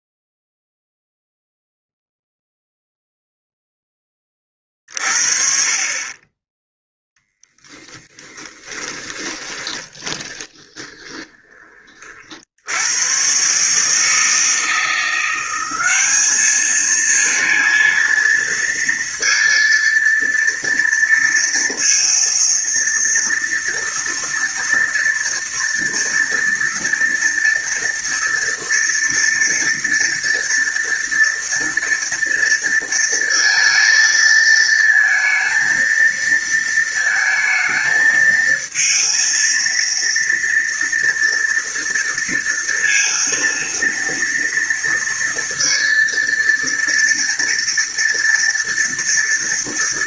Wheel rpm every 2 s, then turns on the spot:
0, 0, 30, 10, 20, 20, 80, 160, 220, 230, 230, 230, 230, 230, 230, 230, 230, 230, 230, 230, 230, 230, 230, 230, 230.
8-12